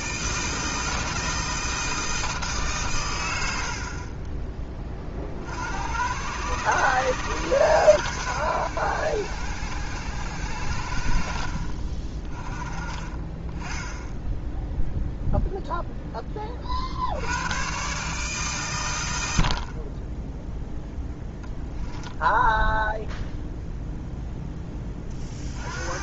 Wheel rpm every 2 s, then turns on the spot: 160, 140, 20, 120, 90, 70, 20, 0, 50, 120, 0, 0, 20.
none